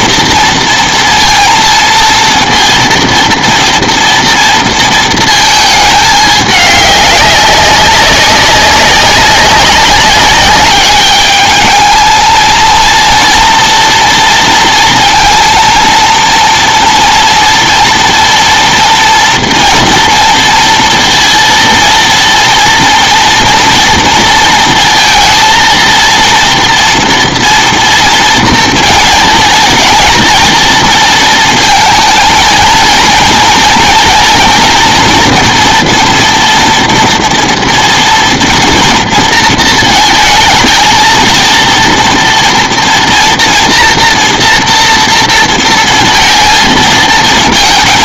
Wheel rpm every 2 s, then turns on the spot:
230, 230, 230, 210, 190, 200, 230, 230, 230, 230, 230, 230, 230, 230, 230, 230, 230, 230, 230, 230, 220, 240, 230, 230.
none